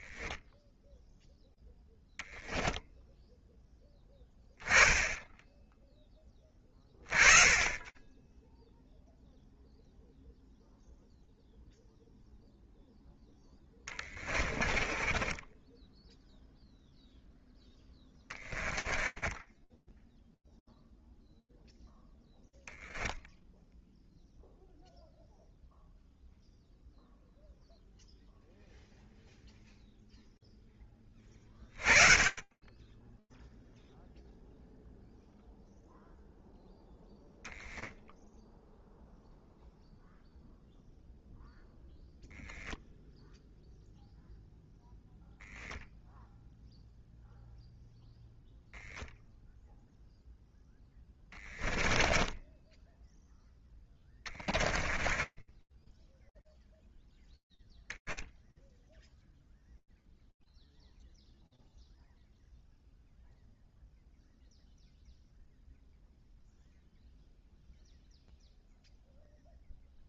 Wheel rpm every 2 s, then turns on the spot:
0, 0, 10, 20, 0, 0, 10, 10, 0, 20, 0, 10, 0, 0, 0, 30, 10, 0, 0, 0, 0, 0, 0, 0, 0, 20, 0, 10, 0, 0, 0, 0, 0, 0, 0.
12-16 18-20 50-52 54-56